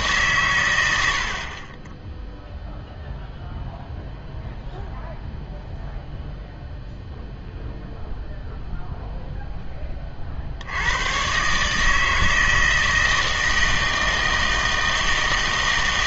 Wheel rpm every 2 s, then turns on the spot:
110, 0, 0, 0, 0, 80, 160, 160.
none